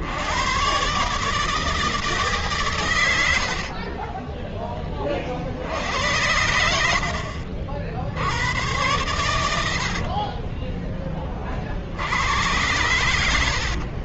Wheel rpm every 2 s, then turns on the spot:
100, 140, 20, 90, 90, 30, 90.
10-12